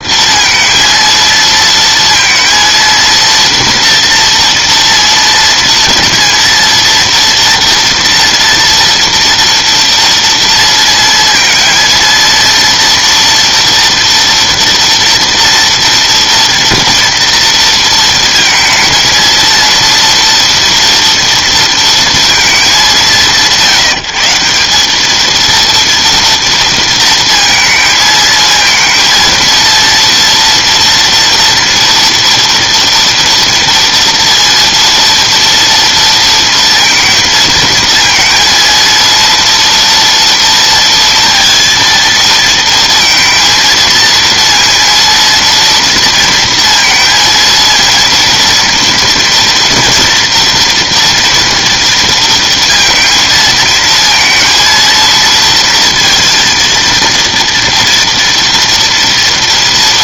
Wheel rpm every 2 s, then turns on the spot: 230, 230, 240, 230, 230, 230, 230, 230, 230, 230, 230, 200, 190, 230, 230, 230, 230, 230, 230, 230, 230, 230, 230, 230, 230, 230, 230, 220, 230, 230.
none